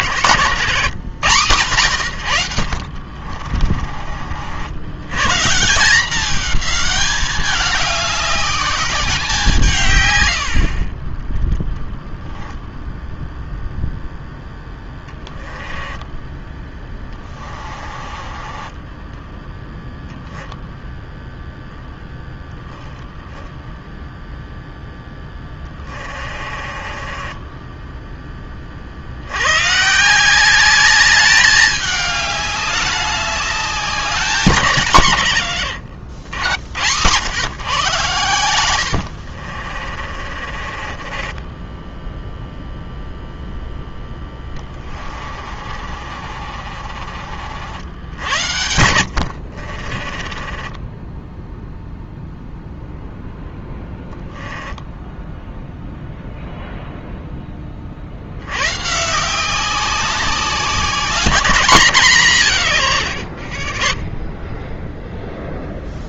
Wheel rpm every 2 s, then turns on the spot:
150, 50, 110, 210, 200, 20, 0, 10, 10, 10, 0, 0, 0, 30, 60, 200, 200, 160, 100, 90, 30, 0, 30, 40, 90, 20, 0, 10, 0, 140, 190, 120, 0.
2-4 14-16 18-20 26-28 38-42 44-52 54-56